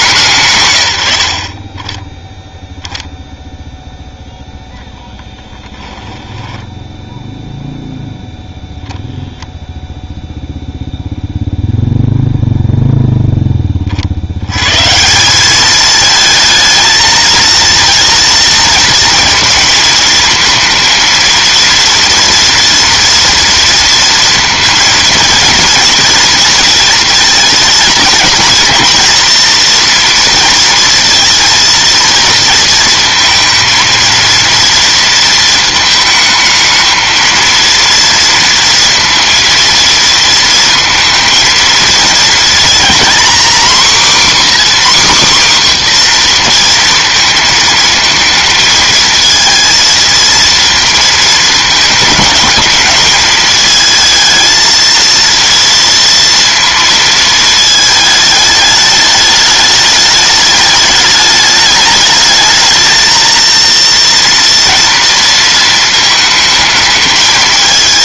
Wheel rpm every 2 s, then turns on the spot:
120, 0, 0, 10, 0, 0, 0, 120, 220, 220, 220, 230, 230, 230, 240, 230, 230, 230, 220, 230, 230, 230, 280, 230, 220, 230, 210, 220, 230, 210, 210, 220, 230, 220.
6-8